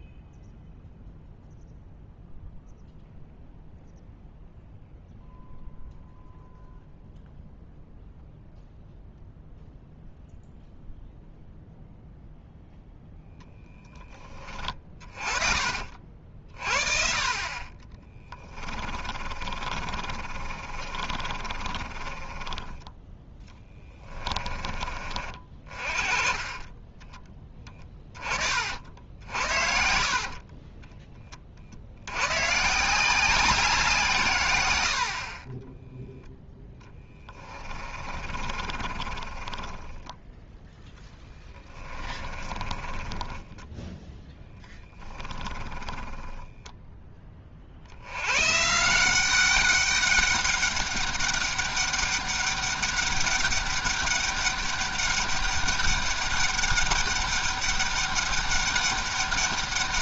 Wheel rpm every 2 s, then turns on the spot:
0, 0, 0, 0, 0, 0, 0, 30, 40, 30, 40, 10, 30, 20, 50, 20, 160, 90, 10, 30, 0, 20, 10, 0, 160, 200, 200, 200, 200, 200.
18-24 36-40 42-46